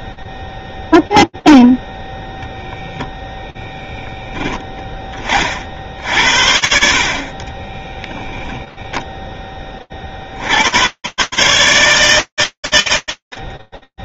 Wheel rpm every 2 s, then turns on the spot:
0, 0, 0, 50, 0, 50, 60.
none